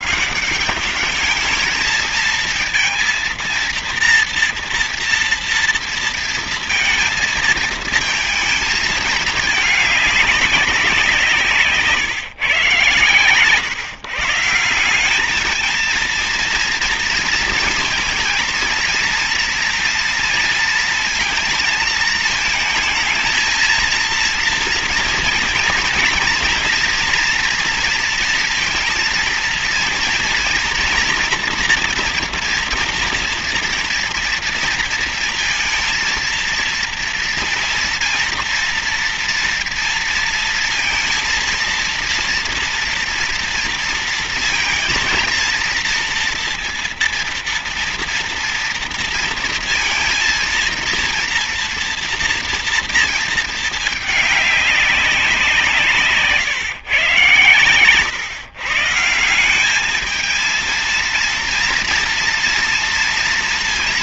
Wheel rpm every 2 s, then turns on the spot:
200, 230, 230, 230, 220, 190, 130, 180, 230, 230, 230, 220, 230, 230, 230, 230, 230, 230, 230, 230, 230, 230, 230, 230, 230, 230, 230, 200, 140, 140, 220, 230.
none